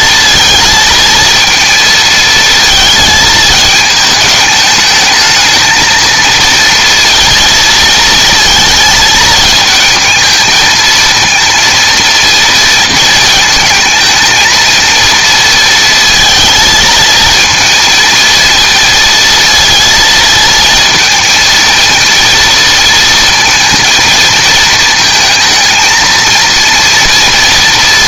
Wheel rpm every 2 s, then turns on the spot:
230, 220, 220, 230, 220, 230, 230, 220, 230, 230, 230, 230, 220, 230.
none